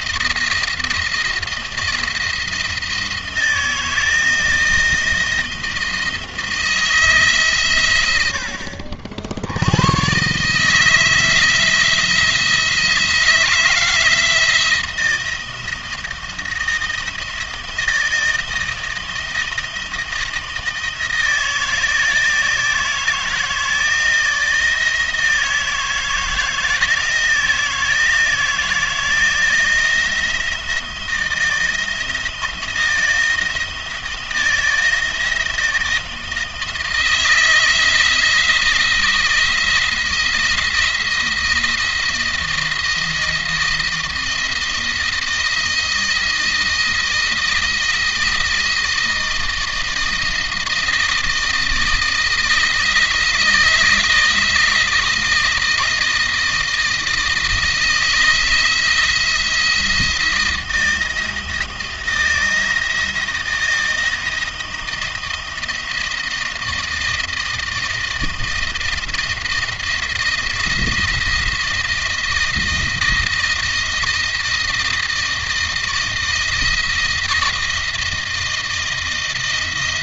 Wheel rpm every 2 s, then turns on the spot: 170, 170, 170, 160, 70, 150, 170, 170, 160, 160, 160, 160, 160, 160, 160, 170, 160, 160, 160, 170, 170, 170, 160, 160, 160, 160, 160, 160, 160, 170, 170, 170, 160, 160, 170, 170, 170, 160, 160, 160.
none